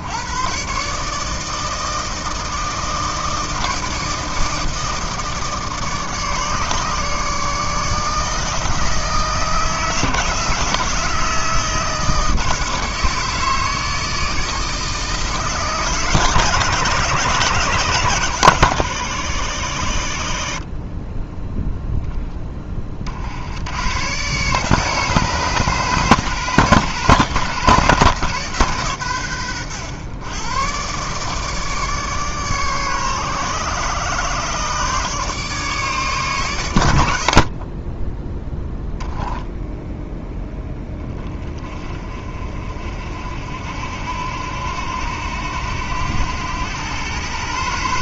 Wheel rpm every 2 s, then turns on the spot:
140, 160, 160, 150, 160, 160, 160, 160, 150, 120, 40, 30, 140, 130, 130, 130, 140, 140, 110, 10, 10, 50, 90, 110.
none